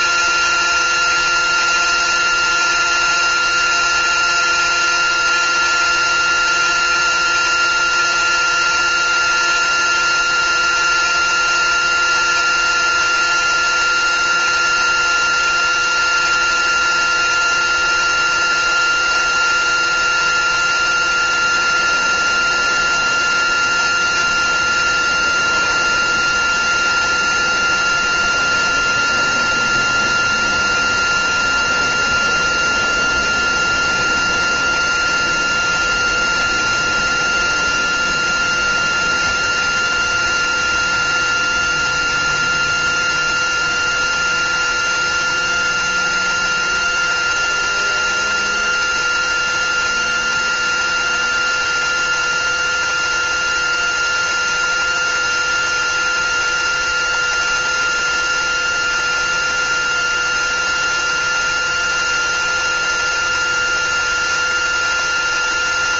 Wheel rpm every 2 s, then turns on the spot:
360, 360, 360, 360, 360, 360, 360, 360, 360, 370, 360, 360, 360, 360, 360, 360, 370, 360, 360, 360, 360, 370, 370, 370, 360, 370, 370, 360, 370, 370, 360, 370, 370.
none